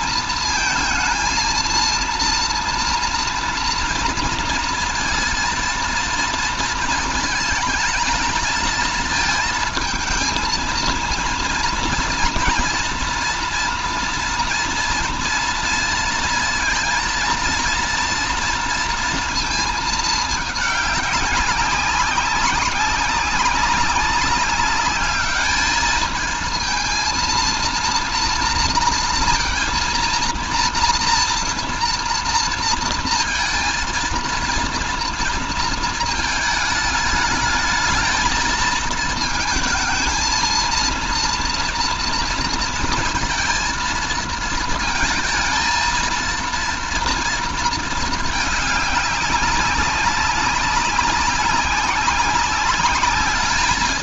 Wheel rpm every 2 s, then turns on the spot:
220, 230, 230, 230, 220, 230, 240, 230, 230, 230, 210, 200, 200, 220, 230, 230, 230, 230, 210, 220, 230, 230, 220, 230, 210, 200, 200.
none